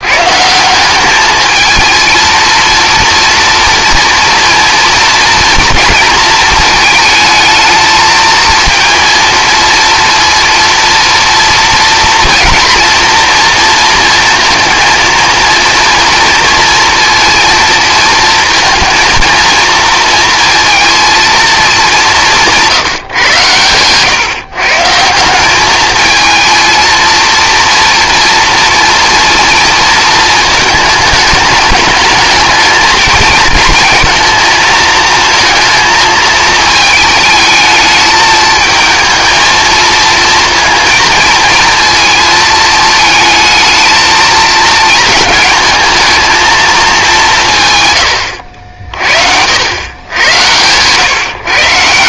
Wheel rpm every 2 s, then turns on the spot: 200, 230, 230, 220, 230, 230, 230, 230, 230, 230, 230, 150, 160, 230, 240, 210, 220, 230, 220, 220, 220, 220, 230, 210, 60, 120.
none